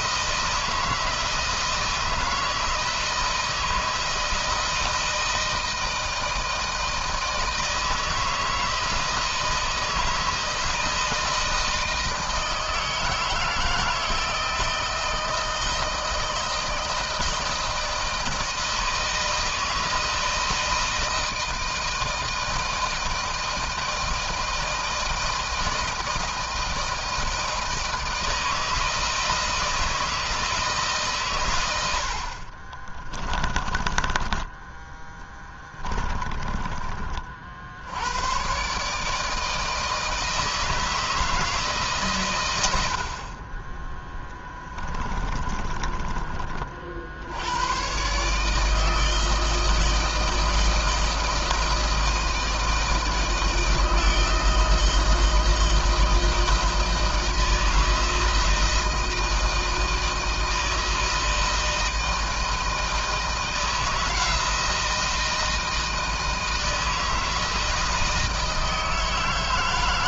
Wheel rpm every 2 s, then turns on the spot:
160, 160, 160, 160, 160, 160, 160, 160, 160, 160, 170, 160, 160, 160, 160, 150, 30, 10, 30, 140, 160, 70, 10, 50, 160, 160, 160, 160, 160, 160, 160, 160, 160, 160, 160.
32-34 44-46